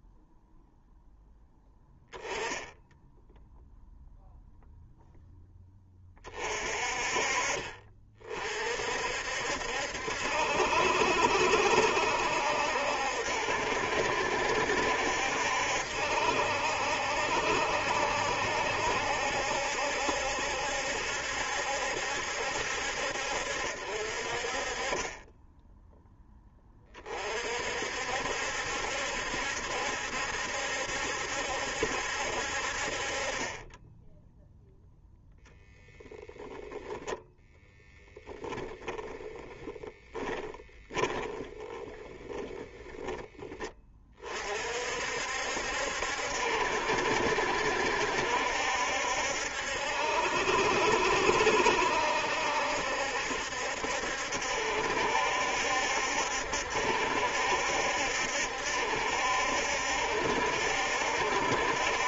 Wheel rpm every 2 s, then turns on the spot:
0, 10, 0, 30, 50, 70, 70, 70, 70, 70, 70, 70, 30, 30, 70, 70, 50, 0, 0, 20, 10, 10, 60, 70, 70, 70, 70, 70, 70, 70, 70.
38-42